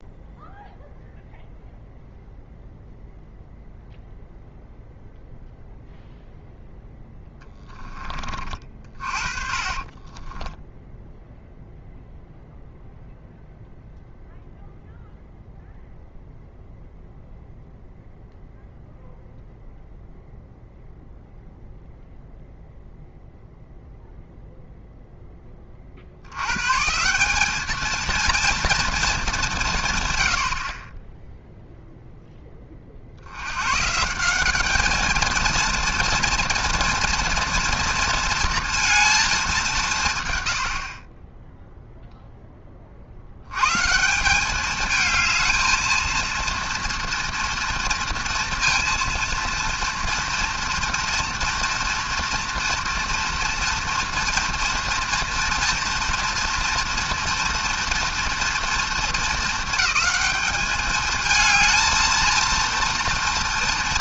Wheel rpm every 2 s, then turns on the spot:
0, 0, 0, 0, 40, 10, 0, 0, 0, 0, 0, 0, 0, 130, 230, 50, 30, 210, 230, 230, 70, 20, 200, 230, 230, 230, 230, 230, 230, 230, 210, 230.
8-10